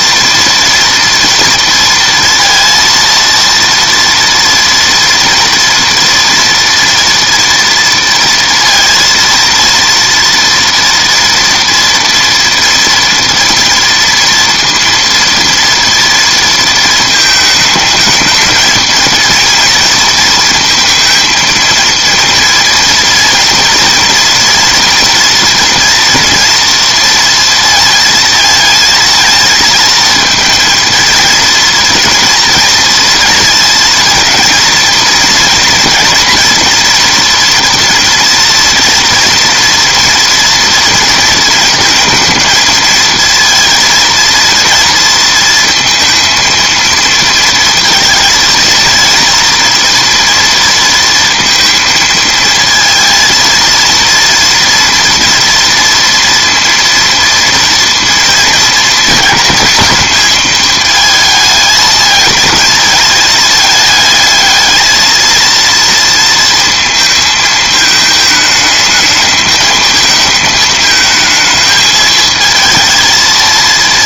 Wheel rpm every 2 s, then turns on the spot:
230, 230, 230, 230, 230, 230, 230, 230, 230, 220, 230, 230, 230, 230, 230, 220, 230, 230, 230, 230, 230, 220, 230, 230, 230, 230, 220, 230, 230, 230, 220, 220, 220, 230, 220, 220, 220.
none